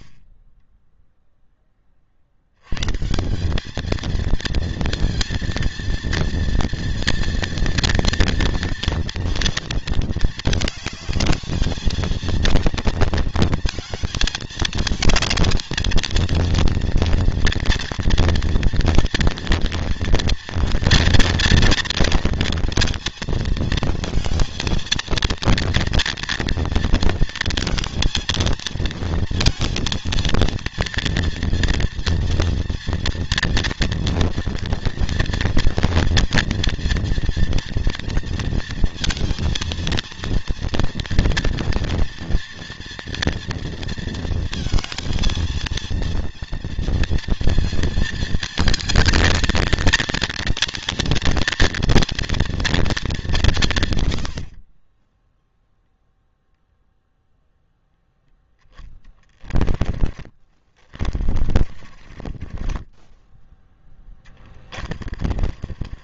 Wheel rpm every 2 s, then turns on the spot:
20, 90, 230, 230, 230, 220, 230, 220, 230, 230, 230, 230, 230, 230, 230, 230, 230, 230, 230, 230, 230, 230, 230, 230, 220, 230, 230, 60, 0, 10, 40, 20, 40.
54-56 58-66